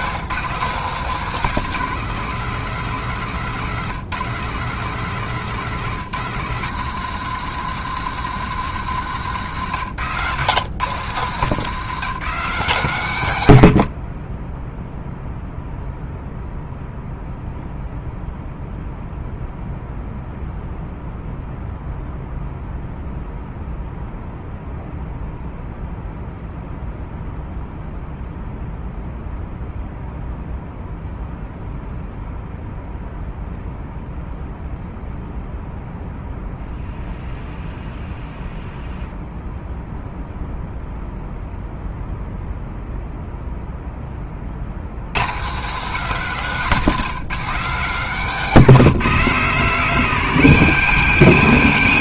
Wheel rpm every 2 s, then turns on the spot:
150, 150, 140, 160, 160, 140, 140, 0, 0, 0, 0, 0, 0, 0, 0, 0, 0, 0, 0, 0, 0, 0, 70, 150, 140, 140.
none